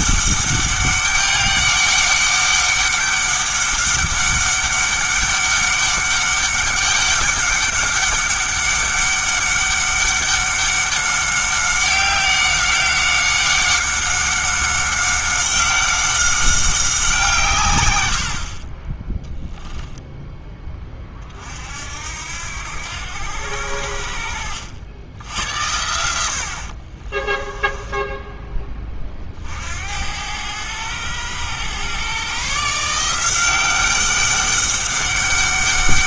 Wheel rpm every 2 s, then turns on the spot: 200, 200, 200, 200, 200, 200, 190, 190, 190, 30, 20, 80, 80, 50, 20, 100, 150, 200.
26-28